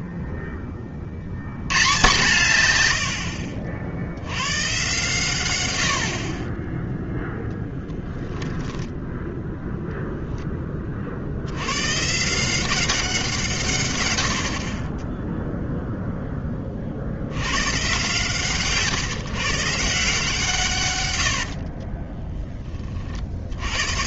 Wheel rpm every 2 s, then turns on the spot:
60, 0, 30, 90, 40, 0, 140, 100, 0, 140, 160, 20.
22-24